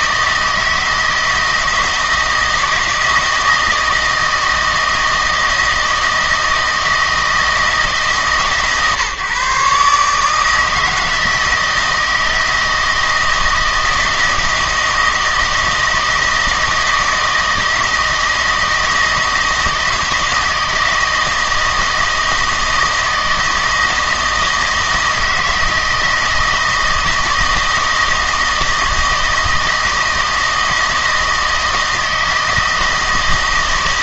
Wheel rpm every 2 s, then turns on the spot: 160, 160, 160, 160, 140, 160, 160, 160, 160, 160, 160, 160, 160, 160, 160, 160, 160.
none